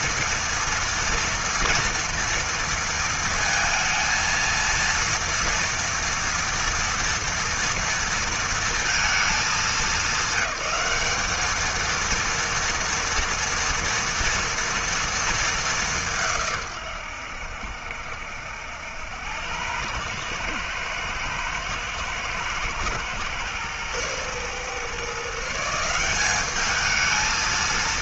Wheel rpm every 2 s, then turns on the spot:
230, 230, 230, 230, 210, 210, 230, 220, 100, 90, 110, 120, 150, 220.
none